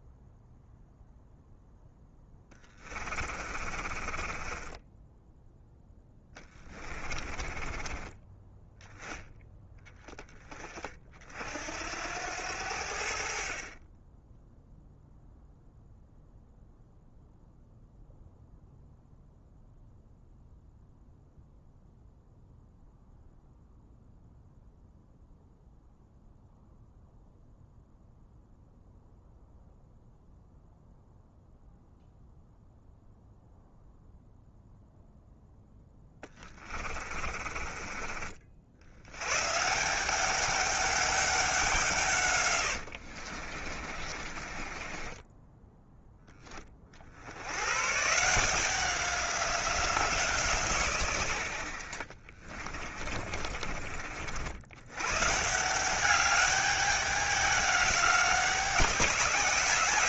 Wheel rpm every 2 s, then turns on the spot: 0, 20, 20, 20, 10, 40, 70, 0, 0, 0, 0, 0, 0, 0, 0, 0, 0, 0, 30, 60, 200, 70, 20, 40, 180, 120, 30, 100, 200, 180.
2-8 36-38 42-46 52-54